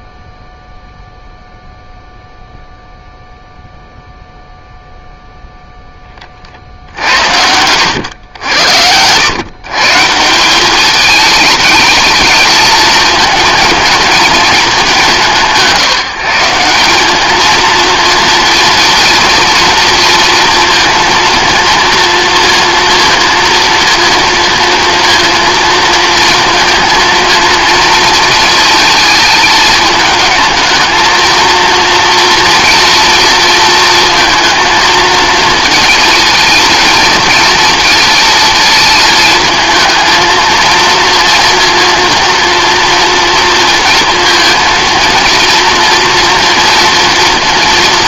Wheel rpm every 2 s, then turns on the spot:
0, 0, 0, 50, 90, 180, 210, 220, 180, 230, 230, 230, 230, 230, 230, 220, 230, 220, 230, 230, 230, 230, 230, 240.
none